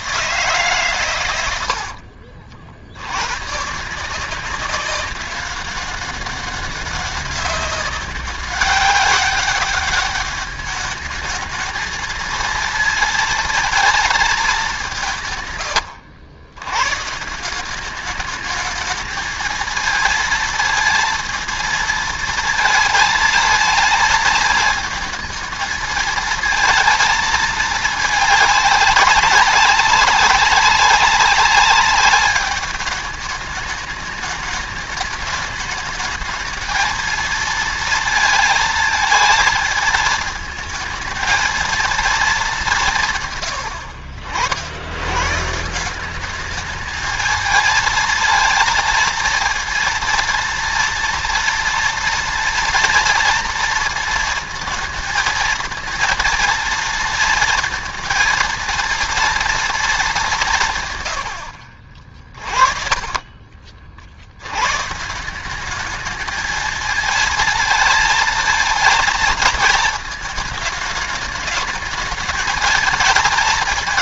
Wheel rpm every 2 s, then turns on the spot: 140, 80, 190, 190, 190, 210, 230, 200, 110, 210, 230, 220, 220, 230, 210, 200, 210, 210, 220, 220, 220, 190, 90, 210, 220, 230, 230, 220, 230, 230, 150, 40, 110, 220, 230, 210, 220.
62-64